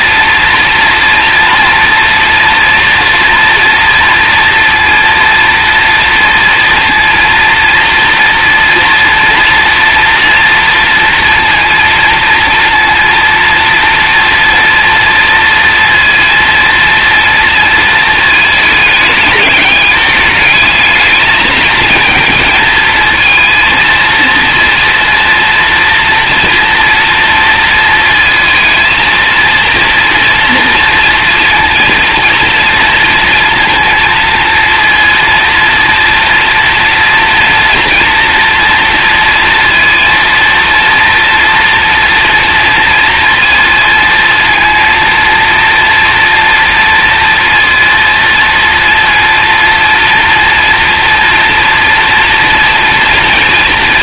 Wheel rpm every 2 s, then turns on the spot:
230, 230, 230, 230, 230, 230, 230, 230, 230, 210, 220, 220, 230, 230, 230, 230, 230, 230, 230, 230, 230, 230, 230, 230, 230, 230, 230.
none